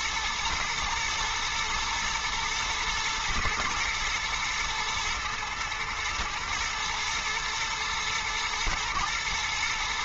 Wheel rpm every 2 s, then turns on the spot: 120, 110, 110, 110, 110.
none